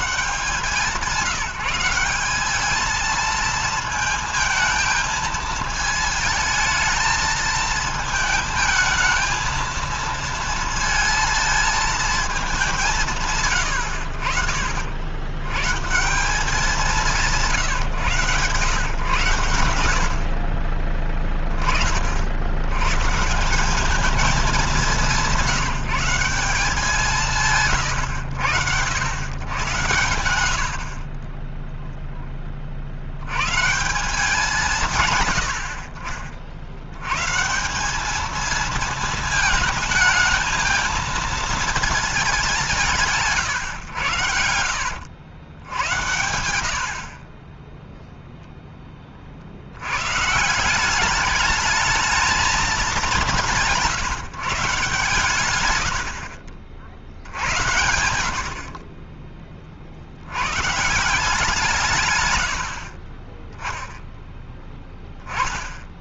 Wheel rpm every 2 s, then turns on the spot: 170, 210, 220, 220, 220, 230, 200, 70, 190, 130, 40, 90, 210, 180, 120, 70, 20, 160, 70, 220, 220, 190, 70, 70, 0, 160, 210, 140, 70, 70, 130, 90, 10.
none